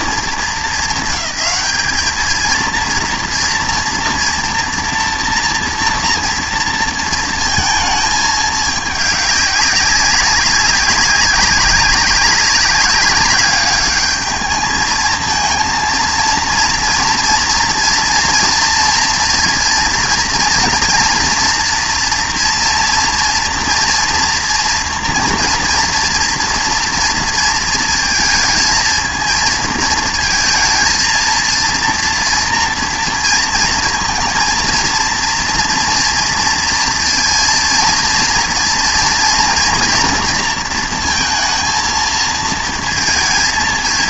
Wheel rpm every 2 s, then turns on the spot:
220, 230, 230, 230, 210, 190, 200, 210, 230, 240, 230, 230, 230, 240, 230, 220, 230, 230, 230, 230, 230, 230.
none